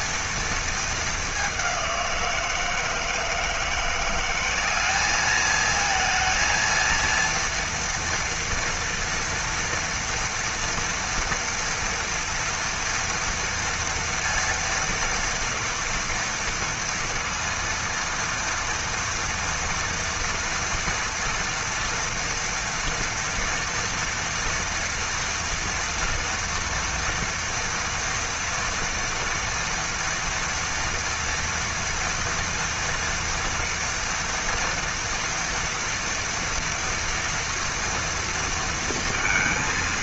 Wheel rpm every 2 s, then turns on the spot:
230, 170, 190, 230, 230, 230, 230, 230, 230, 230, 230, 230, 230, 240, 230, 230, 230, 230, 240, 230.
none